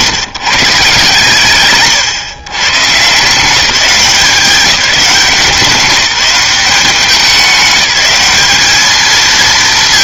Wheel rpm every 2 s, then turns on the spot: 150, 130, 190, 180, 210.
none